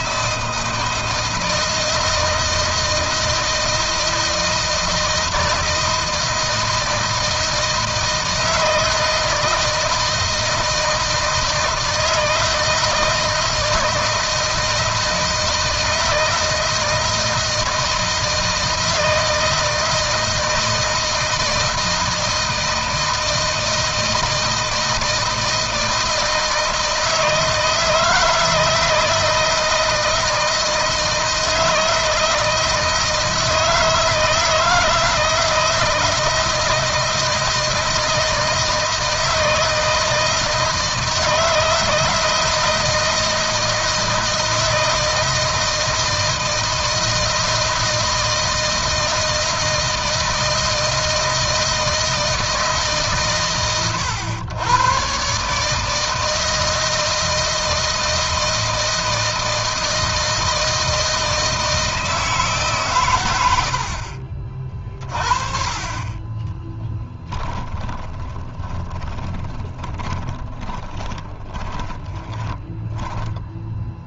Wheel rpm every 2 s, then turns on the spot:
160, 160, 160, 160, 160, 160, 160, 160, 160, 160, 160, 160, 160, 160, 160, 160, 160, 160, 160, 160, 160, 160, 160, 160, 170, 160, 150, 120, 160, 160, 160, 130, 40, 10, 20, 30, 10.
66-74